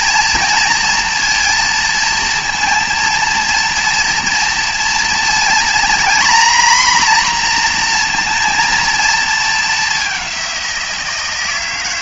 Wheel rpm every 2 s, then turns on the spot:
230, 230, 230, 250, 230, 180.
none